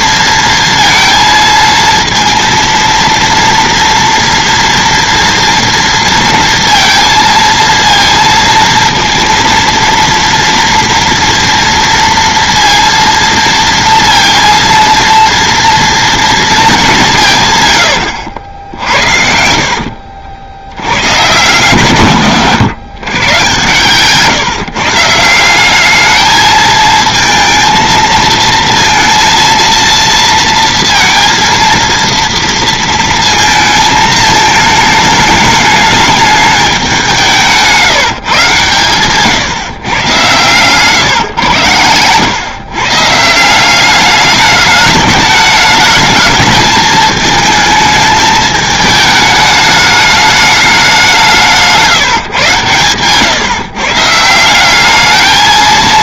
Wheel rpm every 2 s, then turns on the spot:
230, 230, 230, 230, 230, 230, 230, 230, 200, 70, 90, 140, 150, 220, 230, 230, 230, 220, 200, 120, 140, 140, 220, 220, 220, 190, 130, 200.
18-20 38-40 52-54